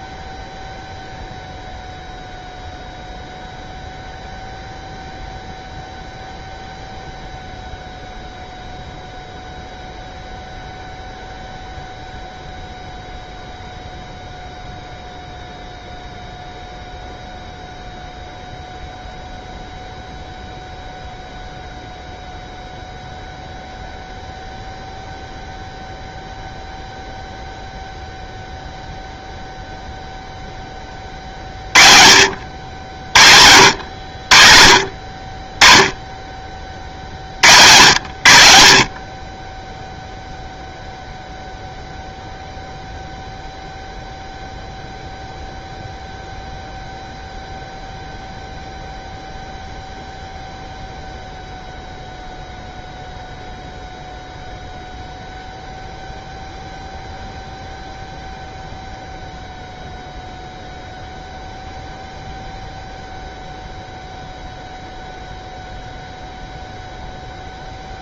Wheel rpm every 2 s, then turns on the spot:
0, 0, 0, 0, 0, 0, 0, 0, 0, 0, 0, 0, 0, 0, 0, 20, 70, 70, 30, 70, 0, 0, 0, 0, 0, 0, 0, 0, 0, 0, 0, 0, 0, 0.
none